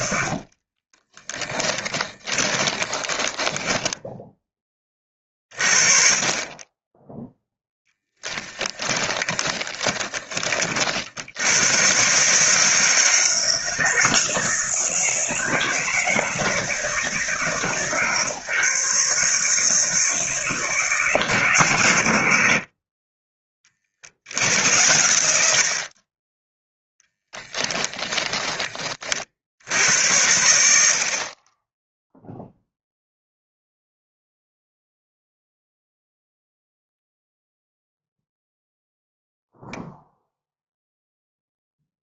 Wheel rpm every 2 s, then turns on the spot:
20, 20, 30, 20, 10, 50, 160, 160, 160, 150, 160, 40, 90, 0, 30, 50, 0, 0, 0, 0, 0.
0-4 8-10